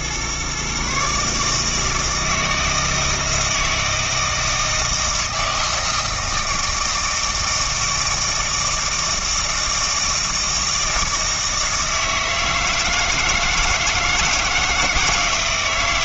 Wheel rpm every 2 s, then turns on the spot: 140, 160, 160, 160, 160, 160, 160, 160.
none